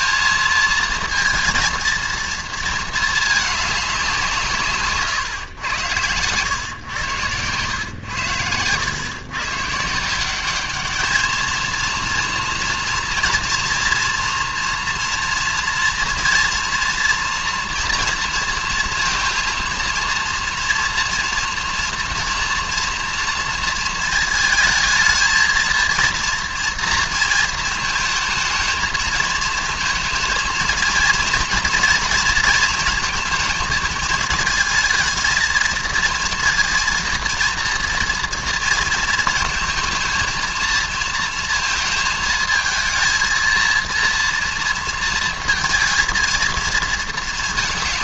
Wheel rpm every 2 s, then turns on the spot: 220, 230, 160, 110, 100, 200, 230, 230, 230, 230, 230, 230, 220, 230, 220, 230, 220, 220, 230, 230, 230, 220, 230, 230.
6-8